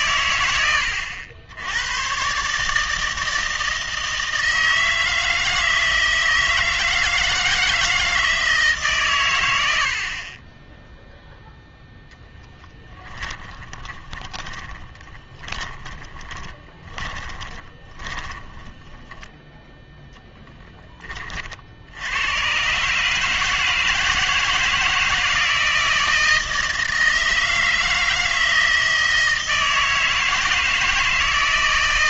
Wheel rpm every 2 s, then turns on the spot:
100, 150, 160, 160, 150, 10, 20, 20, 20, 10, 10, 130, 160, 160, 160, 160.
12-20